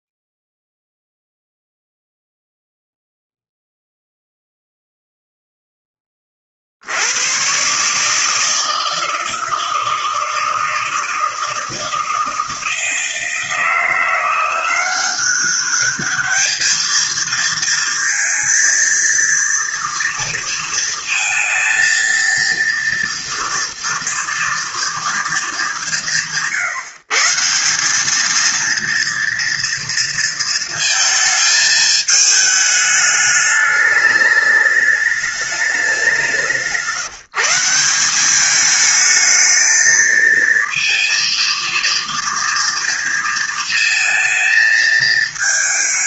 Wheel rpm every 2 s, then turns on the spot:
0, 0, 0, 90, 160, 160, 160, 180, 220, 230, 230, 230, 230, 160, 230, 220, 210, 210, 160, 220, 230, 230, 220.
none